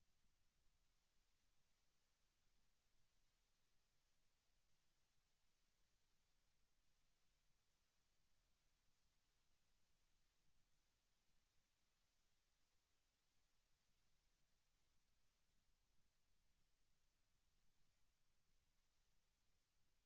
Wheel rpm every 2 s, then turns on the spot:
0, 0, 0, 0, 0, 0, 0, 0, 0, 0.
none